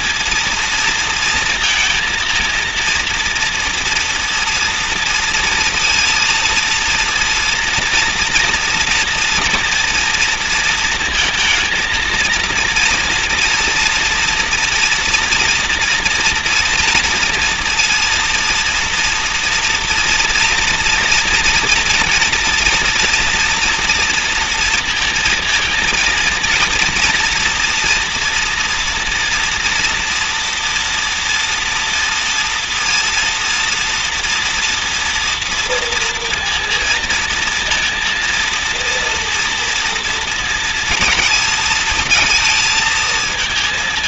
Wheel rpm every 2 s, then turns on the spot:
230, 230, 230, 230, 230, 230, 230, 230, 230, 230, 230, 240, 230, 230, 240, 230, 230, 230, 230, 230, 230, 220.
none